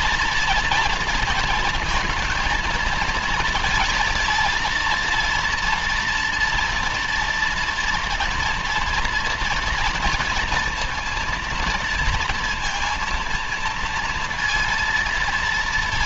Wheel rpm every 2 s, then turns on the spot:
230, 230, 230, 240, 230, 230, 230, 230.
none